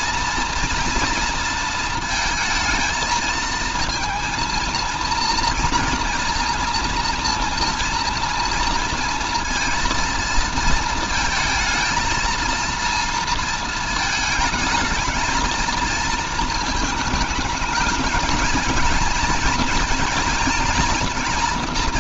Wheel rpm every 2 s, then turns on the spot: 240, 220, 230, 230, 230, 230, 230, 220, 220, 230, 230.
none